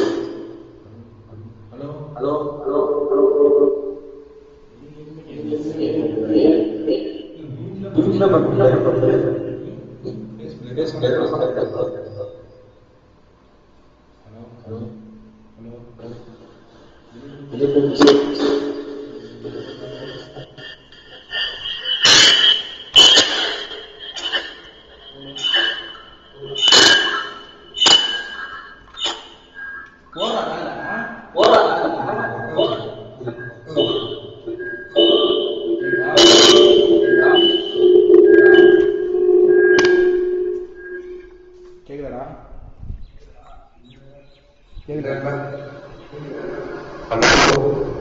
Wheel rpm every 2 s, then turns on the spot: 0, 0, 0, 0, 0, 0, 0, 0, 0, 0, 0, 0, 0, 0, 0, 0, 0, 0, 0, 0, 0, 0, 0, 0.
none